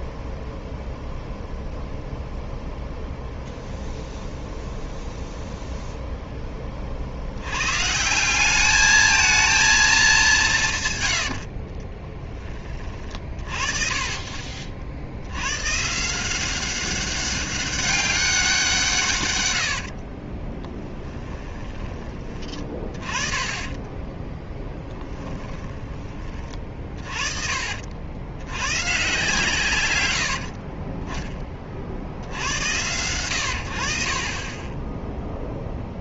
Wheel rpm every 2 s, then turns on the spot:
0, 0, 0, 20, 210, 120, 30, 50, 190, 170, 10, 30, 10, 30, 120, 40, 100, 10.
20-22 30-32